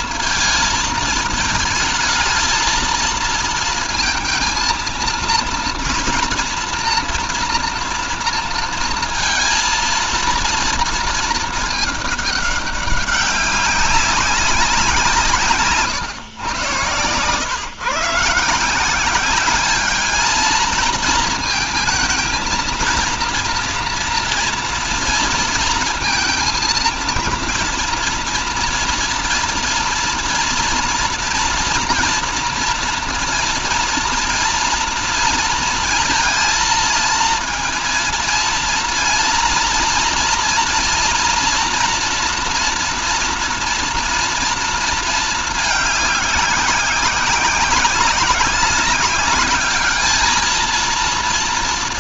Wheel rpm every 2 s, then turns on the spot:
230, 220, 230, 230, 230, 230, 200, 180, 120, 160, 230, 230, 230, 230, 240, 230, 230, 230, 230, 230, 230, 240, 230, 190, 190, 230.
none